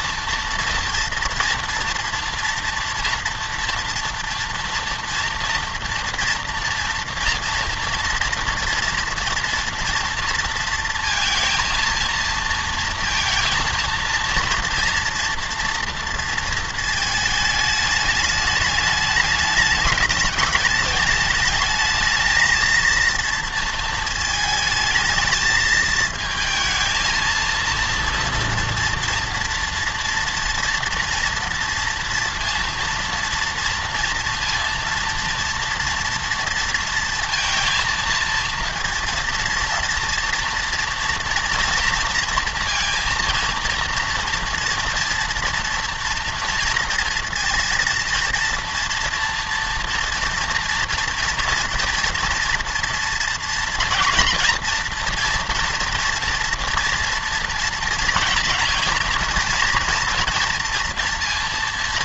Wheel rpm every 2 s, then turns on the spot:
230, 230, 230, 240, 230, 230, 230, 240, 230, 210, 210, 220, 220, 220, 230, 230, 230, 230, 230, 230, 240, 230, 230, 240, 230, 230, 230, 230, 230, 240, 230.
none